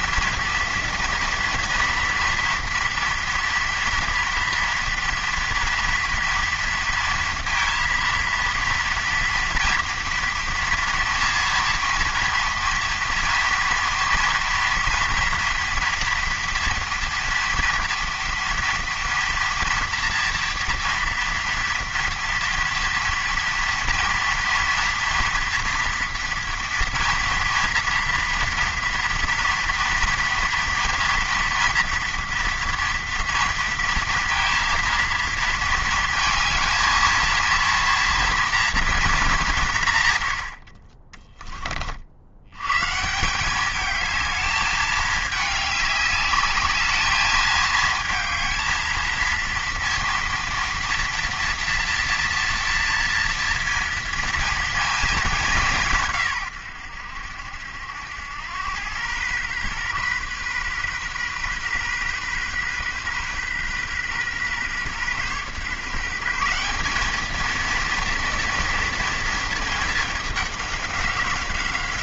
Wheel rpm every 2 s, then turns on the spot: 230, 230, 230, 230, 230, 240, 230, 230, 230, 230, 230, 230, 230, 230, 230, 230, 230, 230, 220, 230, 60, 100, 210, 210, 220, 230, 230, 230, 120, 100, 130, 130, 130, 180, 230, 200.
none